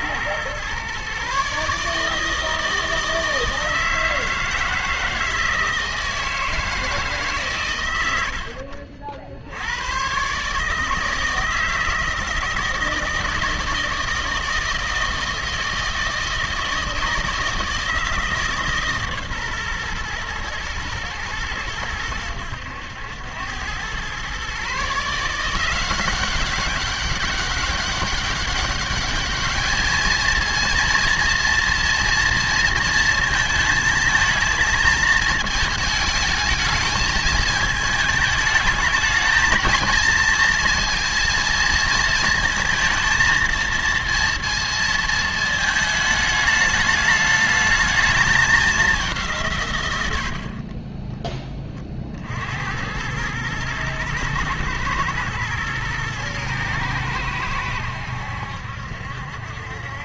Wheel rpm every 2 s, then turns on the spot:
130, 160, 160, 160, 60, 150, 160, 160, 160, 150, 110, 90, 140, 190, 200, 230, 230, 220, 220, 220, 230, 220, 230, 220, 200, 30, 70, 110, 110, 70.
none